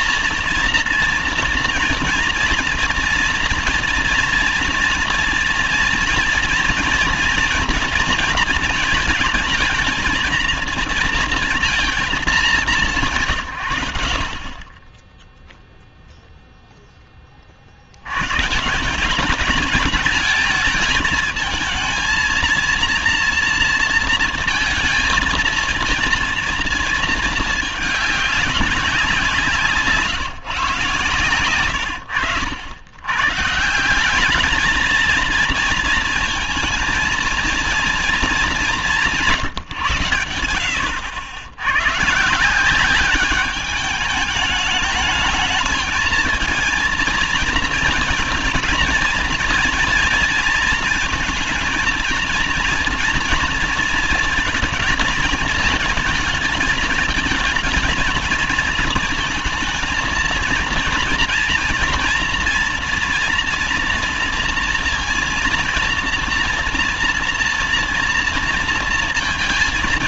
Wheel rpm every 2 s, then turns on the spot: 230, 230, 230, 230, 230, 230, 200, 30, 0, 160, 220, 230, 220, 230, 190, 120, 80, 210, 220, 190, 90, 180, 220, 230, 230, 230, 230, 220, 220, 220, 230, 240, 230, 230, 230.
none